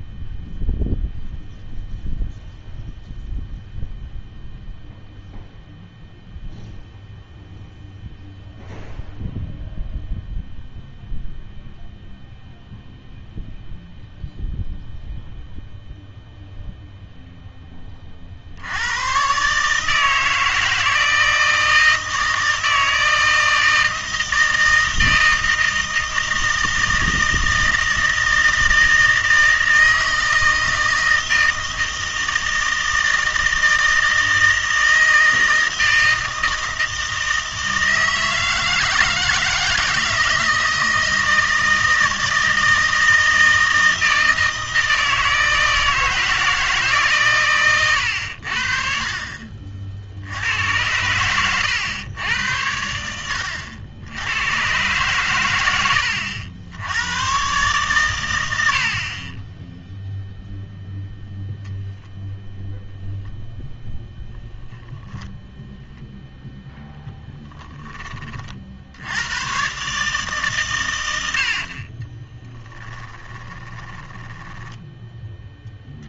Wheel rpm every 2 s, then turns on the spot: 0, 0, 0, 0, 0, 0, 0, 0, 0, 70, 160, 160, 160, 160, 160, 160, 160, 160, 160, 160, 160, 160, 160, 160, 60, 90, 90, 100, 80, 80, 0, 0, 0, 0, 50, 130, 10, 10.
74-76